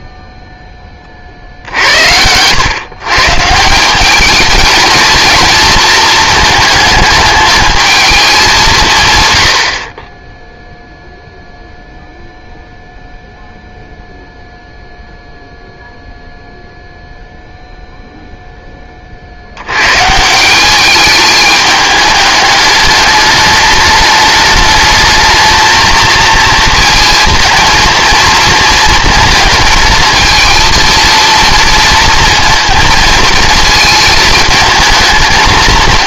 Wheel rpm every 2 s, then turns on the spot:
20, 130, 220, 220, 170, 0, 0, 0, 0, 30, 200, 210, 210, 220, 230, 230, 230, 220.
none